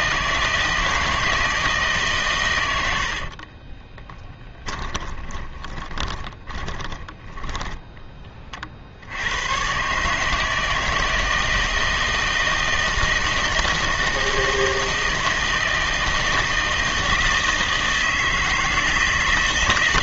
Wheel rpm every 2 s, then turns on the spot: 160, 100, 10, 20, 40, 160, 160, 160, 160, 160.
4-8